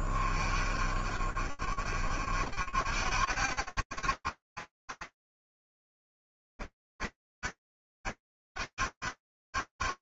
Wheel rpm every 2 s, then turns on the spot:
20, 40, 70, 50, 60.
none